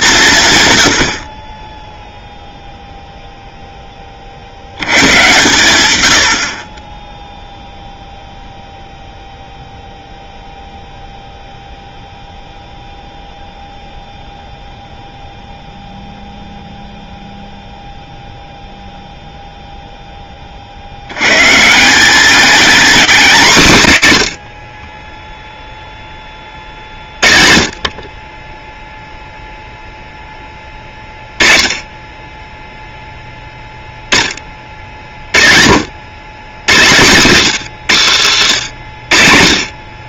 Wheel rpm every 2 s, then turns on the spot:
90, 0, 110, 20, 0, 0, 0, 0, 0, 0, 50, 220, 20, 30, 0, 20, 0, 40, 110, 80.
none